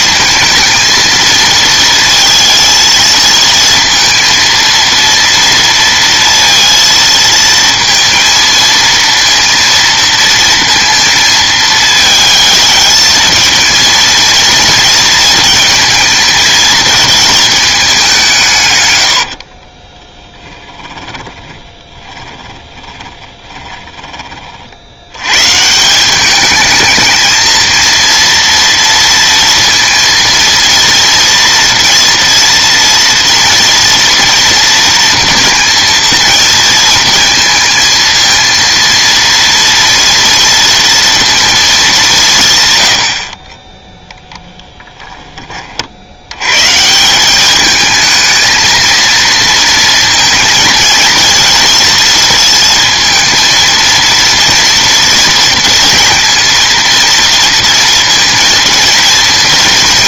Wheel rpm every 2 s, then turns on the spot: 230, 220, 230, 230, 230, 230, 220, 220, 220, 140, 10, 10, 50, 210, 230, 230, 230, 230, 230, 230, 230, 120, 10, 150, 230, 230, 230, 230, 220, 230.
20-24